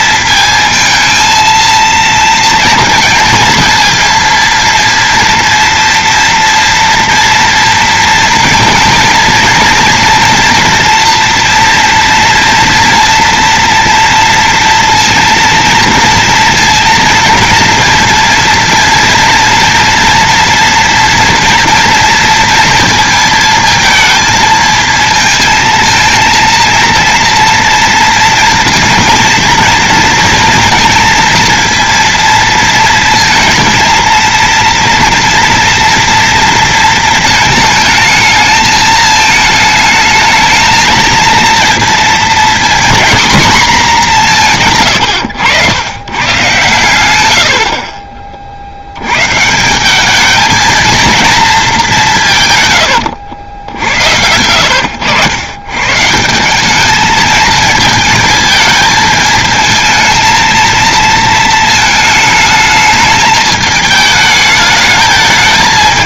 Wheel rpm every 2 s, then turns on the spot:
230, 230, 230, 230, 230, 230, 230, 230, 230, 230, 230, 230, 220, 230, 230, 230, 230, 230, 230, 220, 220, 230, 140, 120, 60, 220, 130, 100, 200, 220, 230, 210, 210.
54-56